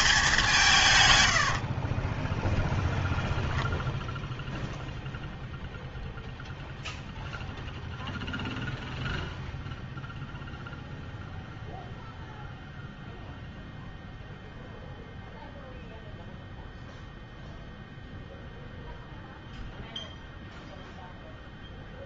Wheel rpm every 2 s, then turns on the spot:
170, 0, 0, 0, 0, 0, 0, 0, 0, 0, 0.
none